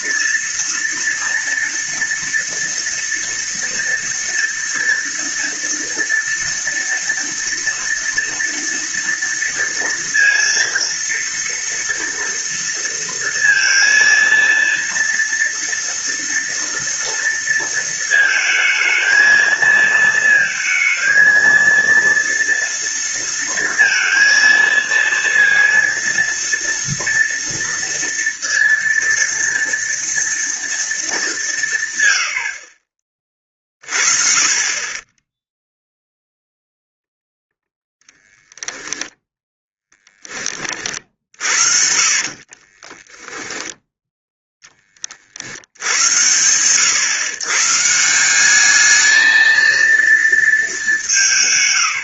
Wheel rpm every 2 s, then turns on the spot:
230, 230, 230, 230, 230, 230, 230, 230, 230, 220, 230, 230, 230, 230, 230, 220, 40, 20, 0, 10, 30, 20, 20, 120, 210, 200.
42-44